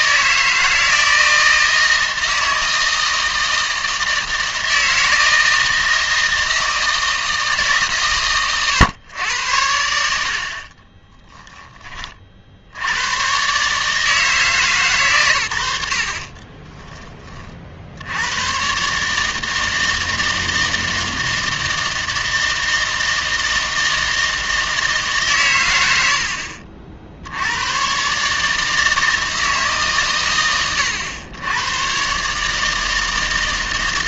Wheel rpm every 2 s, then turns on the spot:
160, 160, 160, 160, 120, 40, 70, 140, 10, 120, 160, 160, 160, 50, 160, 100, 160.
10-12 16-18